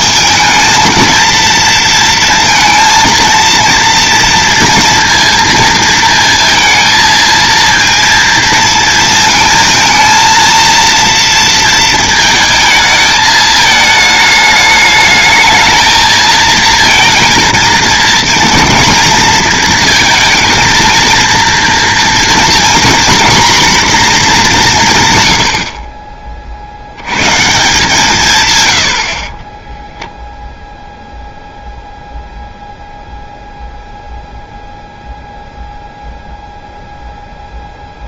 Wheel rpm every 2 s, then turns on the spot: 220, 230, 230, 230, 230, 230, 220, 220, 230, 230, 230, 240, 170, 70, 100, 0, 0, 0, 0.
none